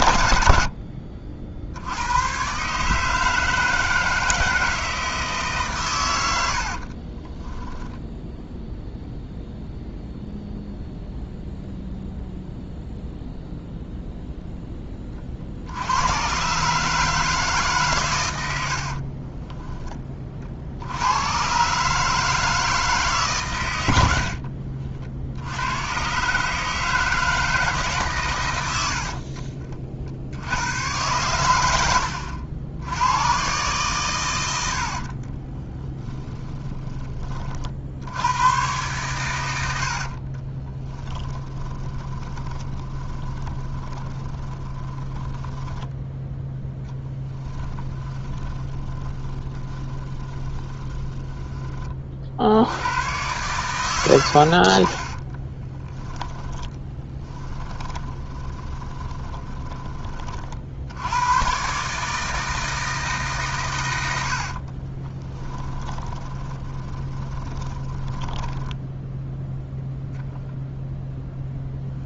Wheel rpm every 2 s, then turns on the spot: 60, 160, 130, 10, 0, 0, 0, 80, 140, 10, 130, 120, 90, 150, 40, 90, 120, 20, 50, 80, 10, 10, 10, 20, 30, 20, 110, 20, 10, 20, 130, 130, 10, 20, 0, 0.
6-8 34-36 38-50 54-58 64-68